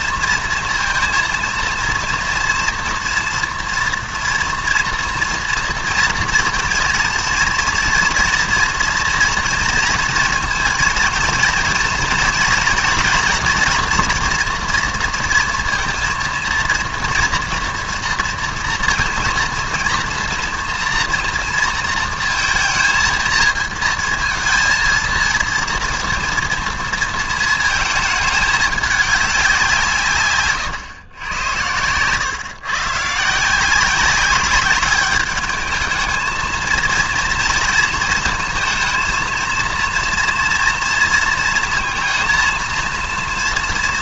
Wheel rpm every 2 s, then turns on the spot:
230, 230, 230, 230, 230, 230, 240, 230, 230, 230, 240, 230, 220, 230, 210, 140, 130, 200, 220, 230, 230, 230.
none